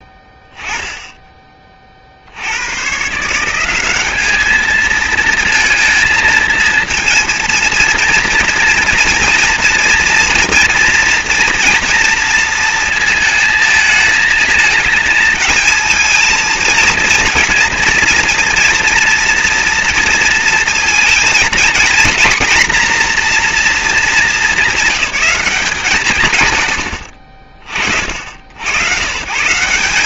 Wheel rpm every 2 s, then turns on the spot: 10, 110, 220, 230, 230, 240, 230, 220, 230, 230, 230, 250, 200, 70, 80.
none